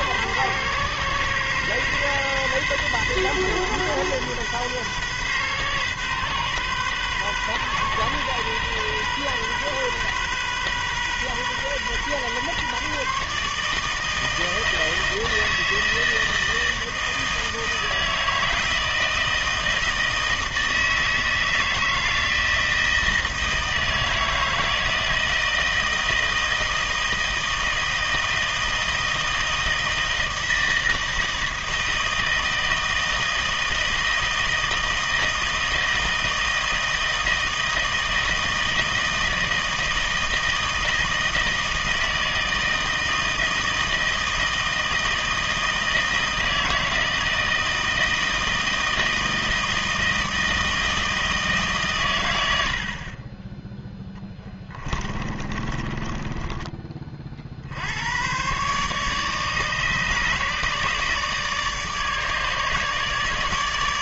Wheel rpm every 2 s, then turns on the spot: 130, 130, 130, 130, 130, 130, 140, 160, 160, 160, 160, 160, 160, 160, 160, 160, 160, 160, 160, 160, 160, 160, 160, 160, 160, 160, 70, 30, 20, 140, 150, 150.
54-56